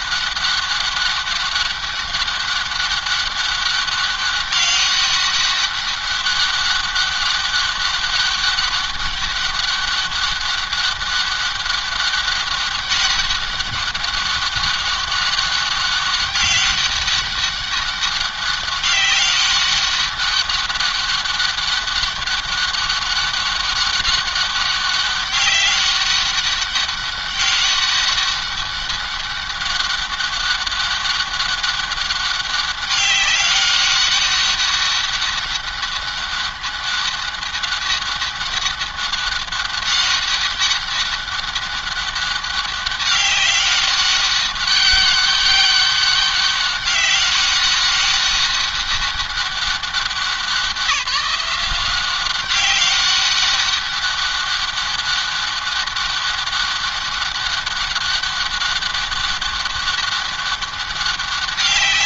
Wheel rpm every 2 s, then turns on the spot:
200, 200, 200, 200, 200, 200, 200, 200, 200, 200, 200, 200, 200, 200, 200, 200, 200, 200, 200, 190, 200, 200, 200, 200, 200, 190, 190, 200, 200, 200, 190.
none